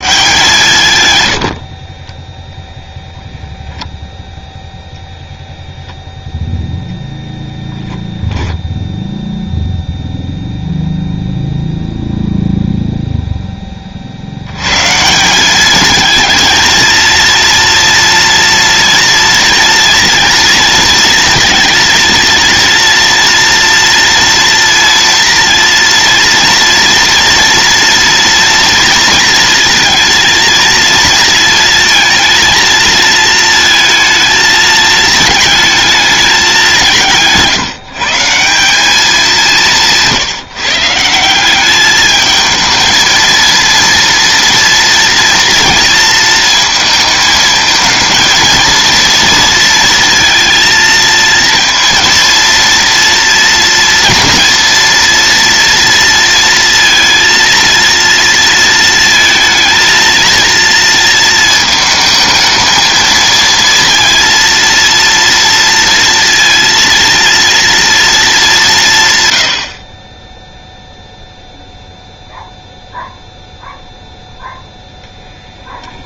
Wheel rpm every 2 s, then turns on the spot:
130, 0, 0, 0, 0, 0, 0, 150, 230, 230, 230, 230, 230, 230, 230, 220, 220, 220, 170, 200, 170, 220, 240, 220, 230, 230, 230, 230, 230, 220, 230, 220, 230, 230, 130, 0, 0, 0.
none